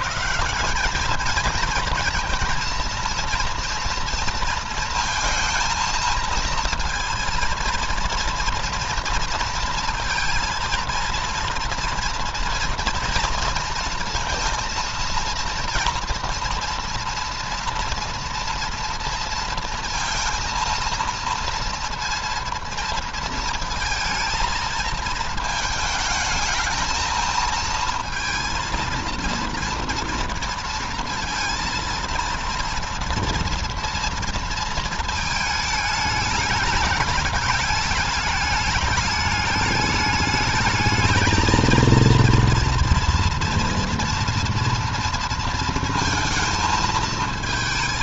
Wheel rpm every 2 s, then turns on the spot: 190, 230, 230, 230, 230, 230, 230, 230, 230, 230, 230, 230, 220, 220, 230, 230, 230, 230, 210, 210, 210, 230, 230, 220.
none